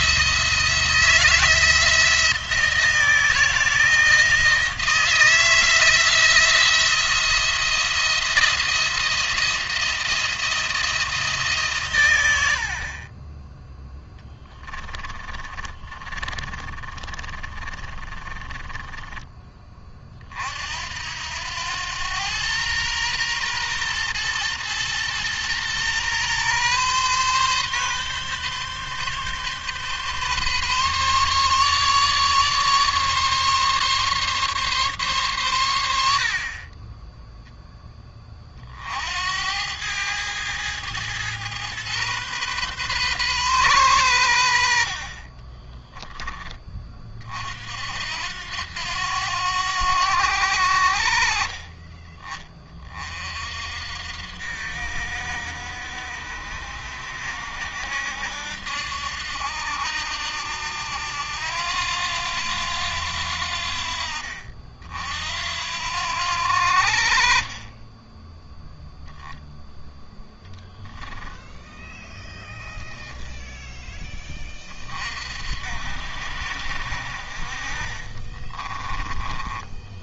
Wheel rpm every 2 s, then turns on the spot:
160, 160, 170, 170, 170, 160, 40, 30, 40, 20, 70, 120, 120, 130, 140, 140, 140, 130, 20, 60, 110, 130, 50, 30, 90, 70, 30, 60, 60, 70, 80, 80, 60, 60, 0, 10, 10, 40, 60, 20.
14-18 78-80